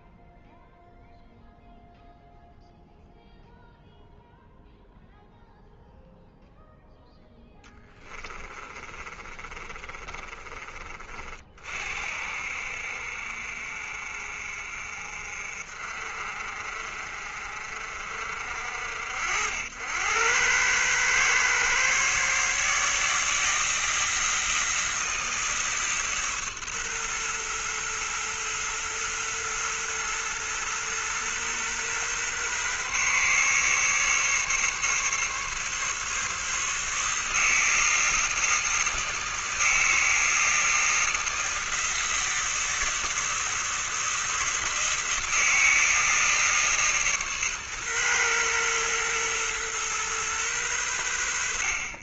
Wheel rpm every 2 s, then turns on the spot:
0, 0, 0, 0, 30, 30, 60, 50, 50, 70, 120, 150, 160, 130, 120, 120, 140, 140, 150, 160, 160, 150, 160, 150, 120, 90.
8-10